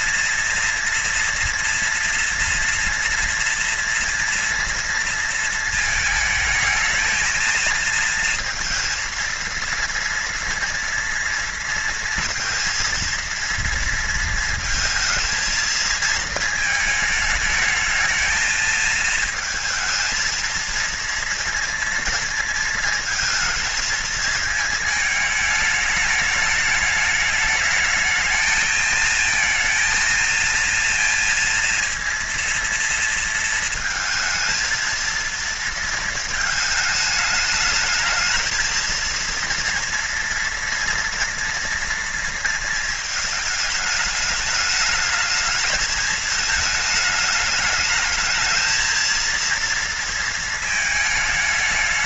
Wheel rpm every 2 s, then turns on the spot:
240, 230, 230, 220, 230, 230, 230, 230, 220, 220, 230, 230, 220, 210, 220, 230, 230, 230, 220, 220, 240, 230, 210, 220, 220, 220.
none